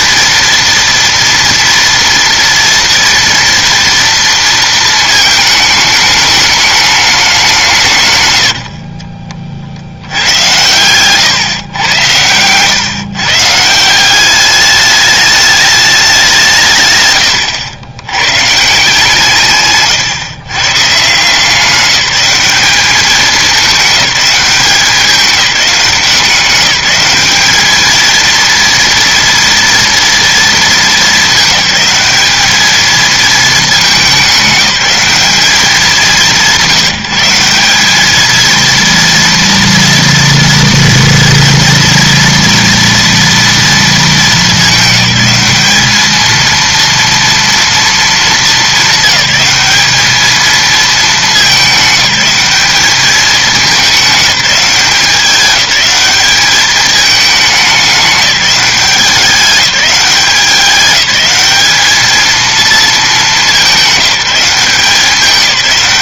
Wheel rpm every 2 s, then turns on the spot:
230, 230, 230, 210, 70, 120, 130, 210, 150, 160, 140, 210, 200, 190, 230, 220, 220, 190, 170, 230, 230, 230, 200, 230, 220, 220, 210, 200, 210, 200, 190, 230, 190.
8-10